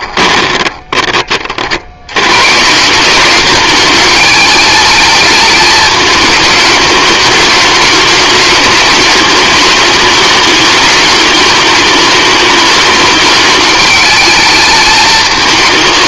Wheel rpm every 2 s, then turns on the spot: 20, 170, 230, 210, 210, 210, 210, 220.
none